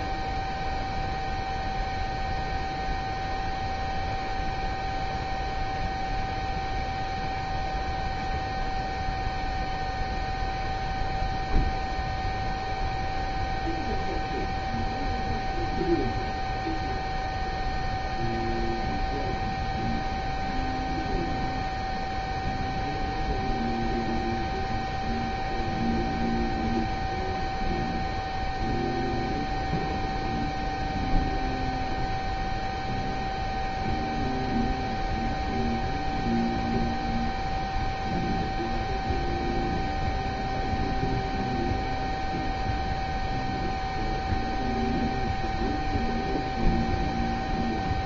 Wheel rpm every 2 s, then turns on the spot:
0, 0, 0, 0, 0, 0, 0, 0, 0, 0, 0, 0, 0, 0, 0, 0, 0, 0, 0, 0, 0, 0, 0, 0.
none